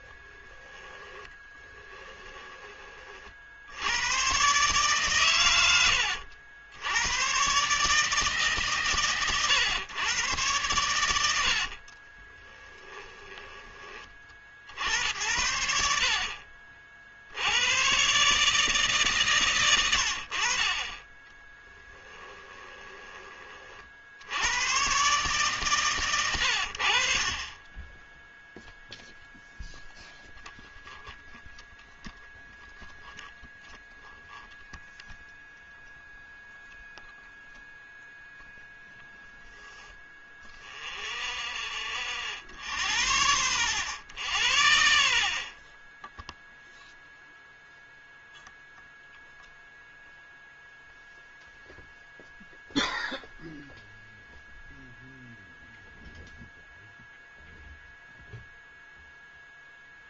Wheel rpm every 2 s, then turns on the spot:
20, 20, 120, 90, 140, 130, 20, 60, 60, 150, 50, 20, 100, 100, 0, 0, 0, 0, 0, 0, 0, 0, 0, 0, 0, 0, 0, 0, 0, 0.
0-4 12-14 22-24